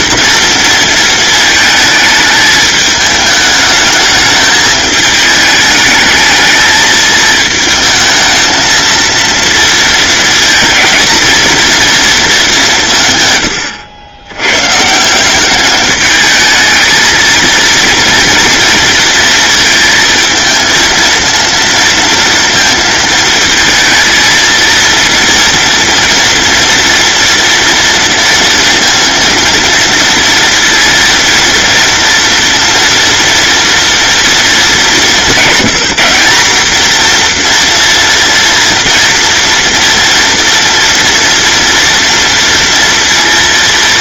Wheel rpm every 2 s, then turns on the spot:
230, 210, 210, 220, 230, 230, 160, 150, 220, 230, 230, 230, 230, 230, 230, 230, 230, 210, 230, 230, 230, 230.
none